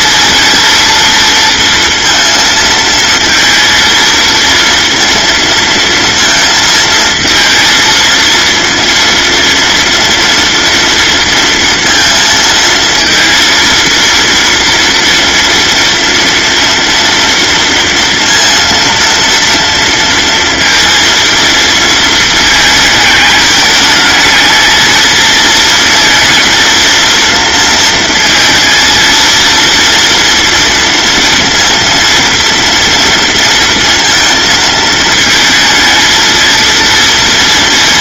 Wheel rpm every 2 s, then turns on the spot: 230, 230, 230, 230, 230, 230, 230, 230, 230, 230, 230, 220, 220, 230, 230, 230, 230, 230, 230.
none